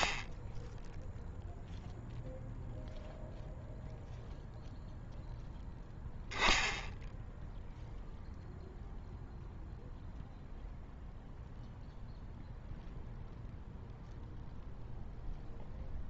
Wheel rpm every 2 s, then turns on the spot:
0, 0, 0, 0, 0, 0, 0, 0.
none